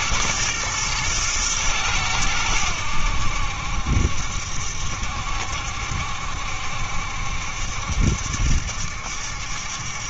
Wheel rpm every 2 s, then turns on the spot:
110, 90, 70, 70, 70.
none